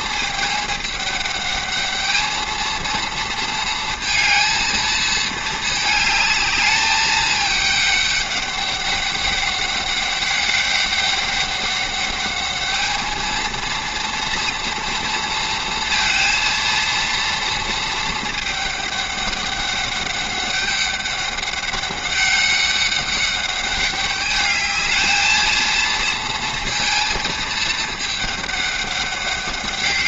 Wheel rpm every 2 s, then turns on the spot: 210, 230, 220, 220, 200, 200, 210, 230, 230, 210, 200, 200, 210, 230, 200.
none